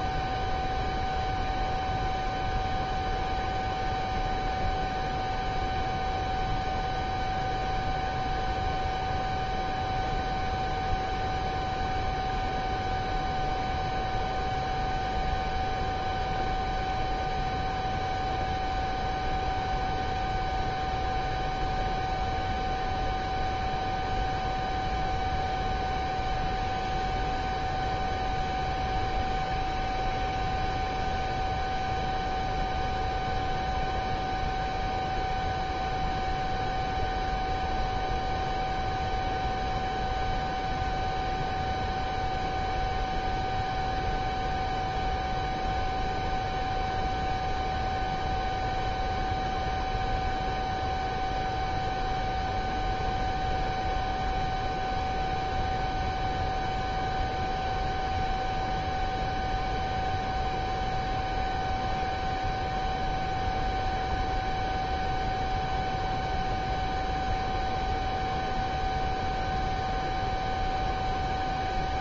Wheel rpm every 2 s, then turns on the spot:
0, 0, 0, 0, 0, 0, 0, 0, 0, 0, 0, 0, 0, 0, 0, 0, 0, 0, 0, 0, 0, 0, 0, 0, 0, 0, 0, 0, 0, 0, 0, 0, 0, 0, 0, 0.
none